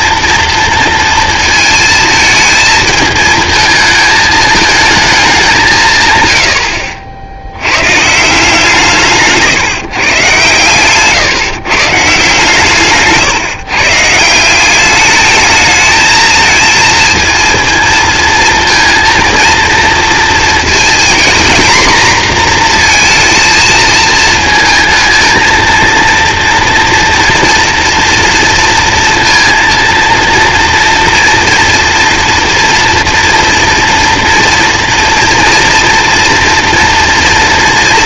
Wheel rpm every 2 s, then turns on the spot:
230, 220, 220, 80, 170, 120, 150, 180, 230, 230, 230, 240, 230, 230, 230, 230, 230, 230, 240.
none